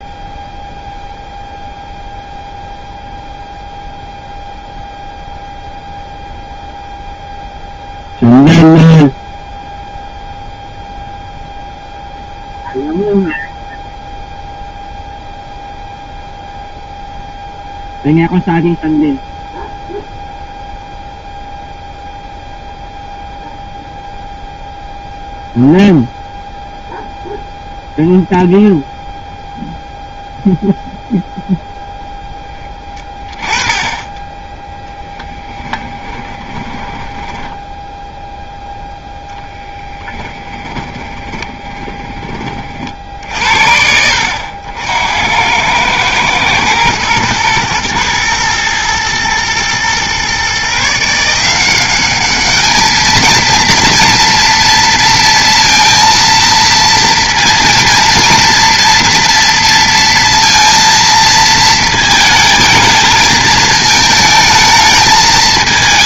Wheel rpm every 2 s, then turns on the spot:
0, 0, 0, 0, 0, 0, 0, 0, 0, 0, 0, 0, 0, 0, 0, 0, 10, 10, 10, 0, 20, 40, 80, 110, 120, 140, 220, 230, 230, 230, 230, 220, 220.
36-38 40-42